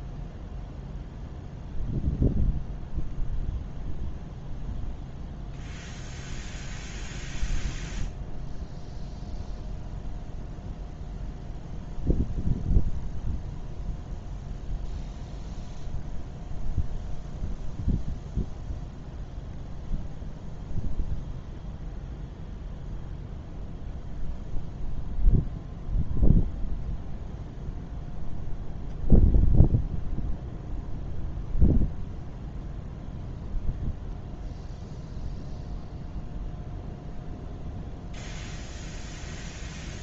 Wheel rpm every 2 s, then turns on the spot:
0, 0, 0, 0, 0, 0, 0, 0, 0, 0, 0, 0, 0, 0, 0, 0, 0, 0, 0, 0.
none